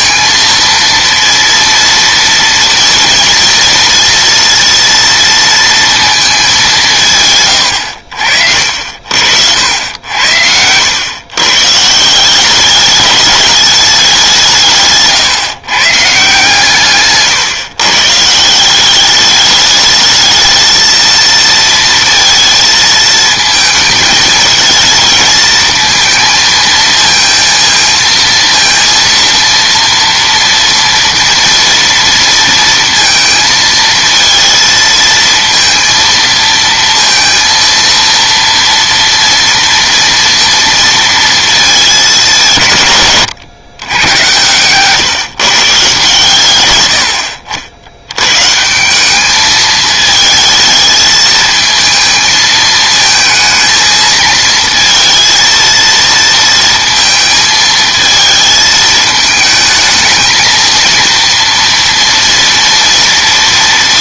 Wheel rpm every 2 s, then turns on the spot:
230, 230, 230, 190, 60, 90, 190, 160, 140, 170, 220, 230, 220, 230, 230, 230, 230, 230, 230, 230, 230, 170, 130, 100, 150, 220, 220, 230, 230, 220, 230, 230.
8-10